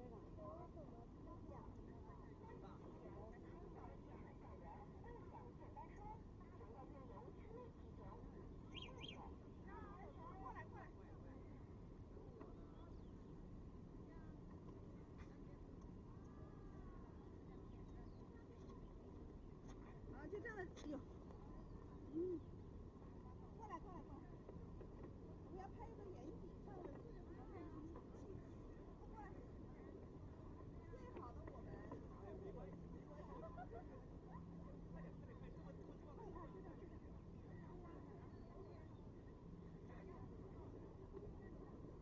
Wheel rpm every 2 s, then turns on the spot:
0, 0, 0, 0, 0, 0, 0, 0, 0, 0, 0, 0, 0, 0, 0, 0, 0, 0, 0, 0, 0.
none